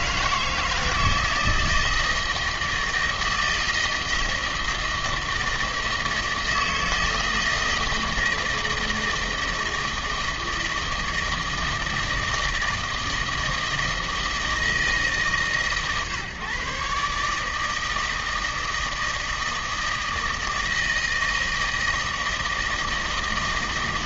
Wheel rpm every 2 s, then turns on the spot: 160, 160, 160, 160, 160, 160, 160, 160, 140, 160, 160, 160.
none